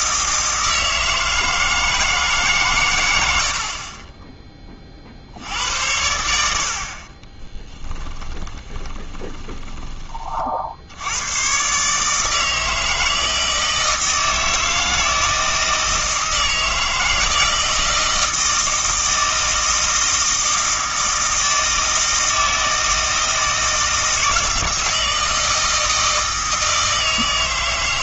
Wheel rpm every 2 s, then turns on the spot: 160, 130, 20, 60, 20, 60, 160, 160, 160, 160, 160, 160, 160, 160.
8-10